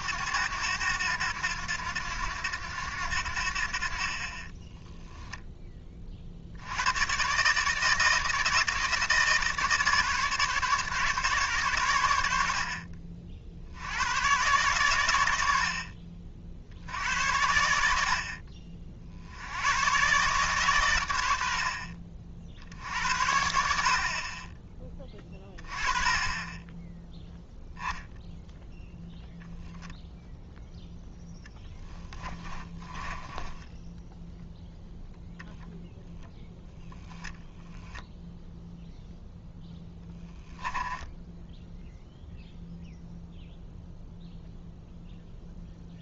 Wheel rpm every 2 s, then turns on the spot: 100, 90, 20, 70, 160, 150, 50, 120, 70, 50, 130, 70, 20, 10, 0, 0, 20, 0, 0, 0, 10, 0, 0.
4-6 32-34 40-42